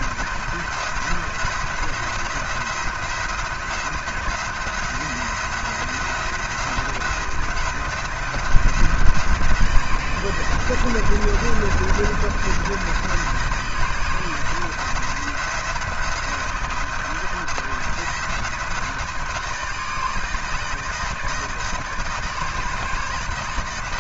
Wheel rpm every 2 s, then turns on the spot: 170, 170, 170, 170, 170, 170, 170, 170, 170, 170, 160, 160.
none